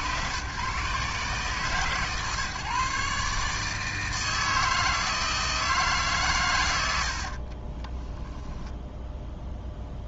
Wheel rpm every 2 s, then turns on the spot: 120, 140, 160, 110, 10.
8-10